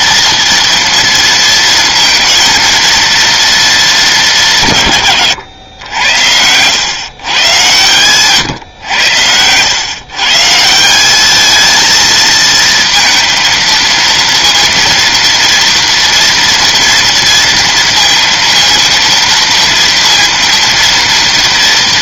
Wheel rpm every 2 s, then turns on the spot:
230, 230, 160, 110, 120, 150, 220, 230, 230, 230, 230.
none